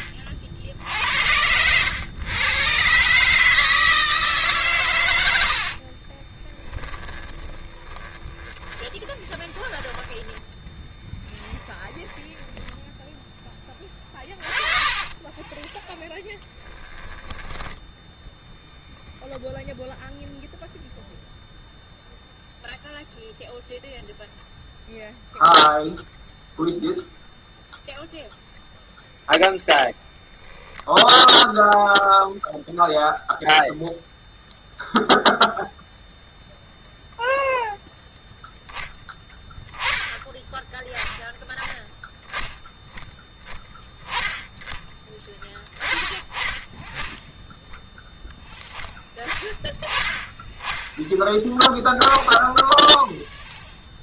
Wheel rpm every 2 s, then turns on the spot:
80, 130, 120, 10, 10, 10, 20, 30, 20, 0, 0, 0, 0, 0, 0, 0, 0, 0, 0, 10, 10, 10, 10, 10, 0, 10, 0.
6-18